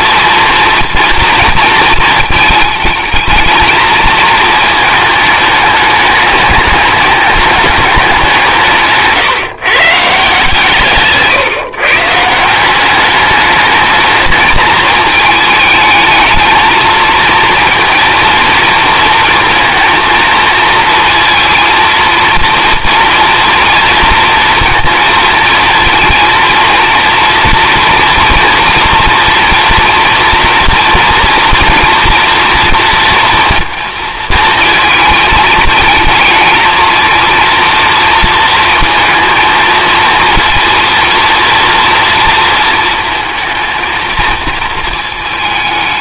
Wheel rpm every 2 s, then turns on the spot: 230, 220, 210, 210, 160, 150, 180, 220, 230, 230, 220, 230, 230, 230, 230, 230, 230, 220, 220, 230, 230, 230, 220.
none